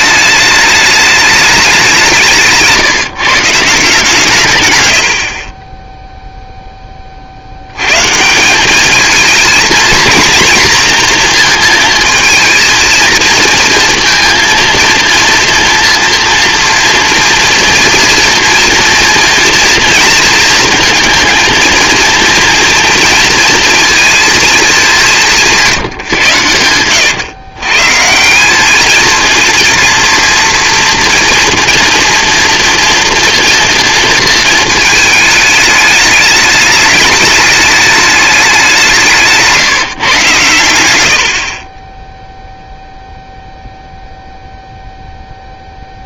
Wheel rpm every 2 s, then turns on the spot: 210, 160, 140, 10, 190, 240, 230, 230, 230, 230, 220, 230, 210, 100, 200, 230, 230, 220, 210, 200, 100, 0, 0.
26-28